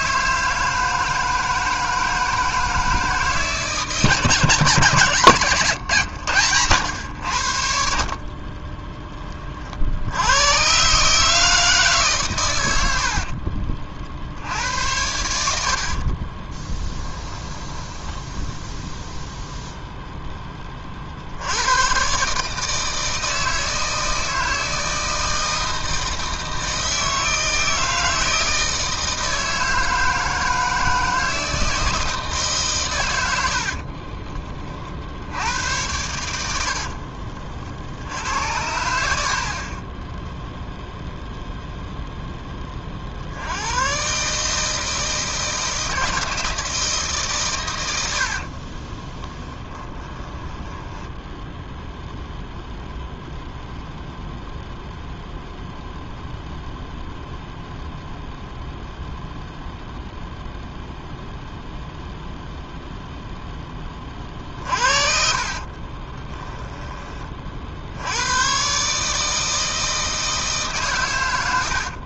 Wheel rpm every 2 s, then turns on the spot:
160, 160, 150, 90, 20, 140, 80, 80, 10, 0, 40, 160, 160, 160, 160, 160, 120, 50, 60, 80, 0, 40, 160, 160, 20, 10, 0, 0, 0, 0, 0, 0, 40, 20, 140, 140.
8-10 16-18 36-38 48-52 64-66